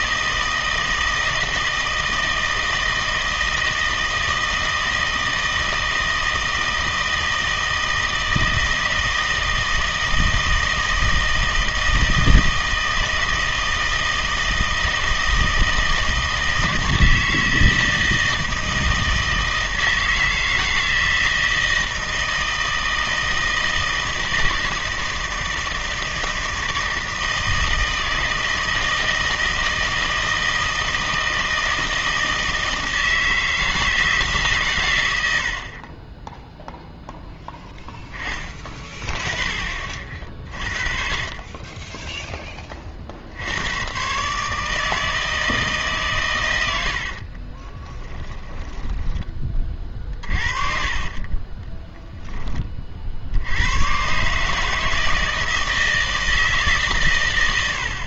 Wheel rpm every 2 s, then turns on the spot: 160, 160, 160, 160, 160, 160, 160, 160, 160, 160, 160, 160, 160, 160, 160, 160, 160, 130, 0, 30, 40, 30, 160, 90, 20, 50, 30, 150, 150.
48-52